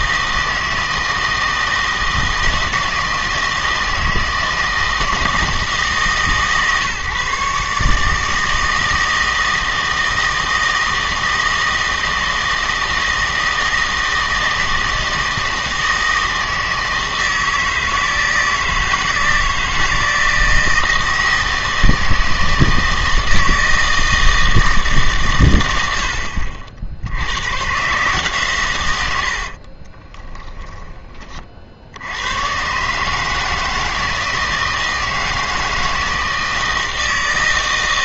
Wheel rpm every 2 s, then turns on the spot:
160, 160, 160, 140, 160, 160, 160, 160, 160, 160, 160, 160, 160, 70, 130, 10, 130, 160, 160.
30-32